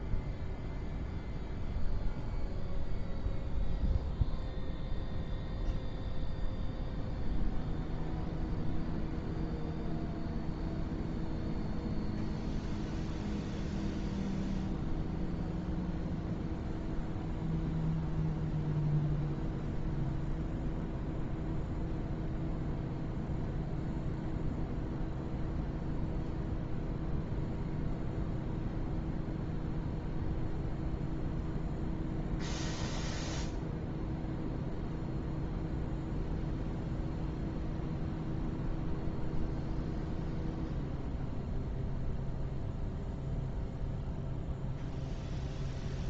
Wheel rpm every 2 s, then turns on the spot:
0, 0, 0, 0, 0, 0, 0, 0, 0, 0, 0, 0, 0, 0, 0, 0, 0, 0, 0, 0, 0, 0, 0.
none